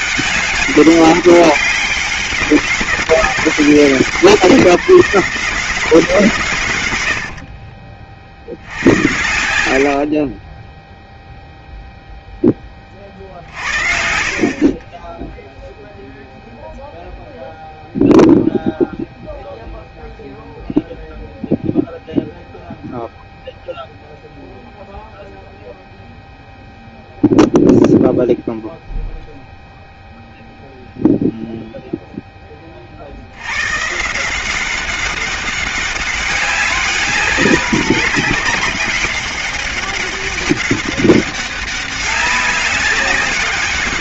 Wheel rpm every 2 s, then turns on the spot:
200, 200, 170, 110, 70, 10, 30, 30, 0, 0, 0, 0, 0, 0, 0, 0, 30, 190, 190, 200, 200, 190.
14-16